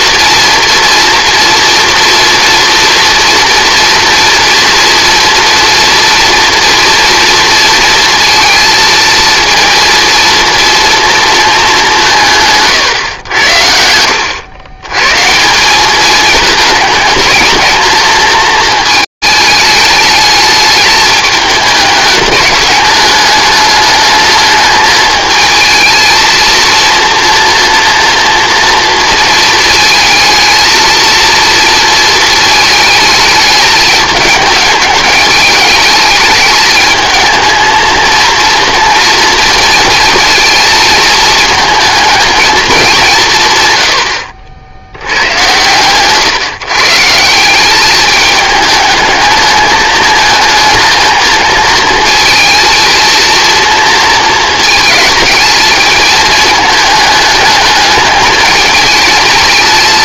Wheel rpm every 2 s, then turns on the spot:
230, 240, 230, 230, 230, 230, 120, 120, 210, 220, 210, 210, 220, 230, 230, 230, 220, 210, 220, 230, 220, 170, 80, 160, 220, 220, 230, 220, 210, 220.
none